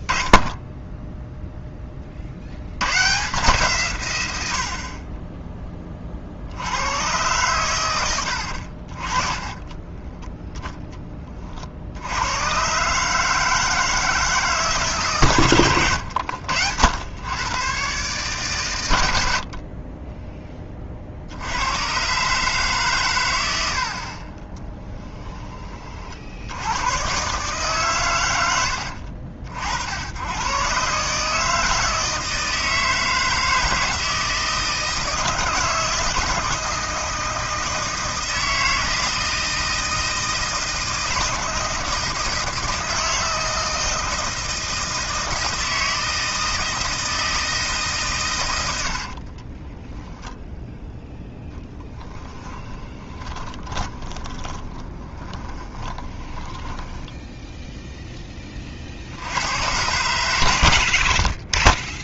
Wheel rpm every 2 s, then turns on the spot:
10, 90, 60, 80, 50, 10, 130, 140, 90, 110, 30, 140, 10, 90, 90, 130, 160, 160, 160, 160, 160, 160, 160, 160, 80, 0, 20, 20, 10, 60, 70.
24-26 52-58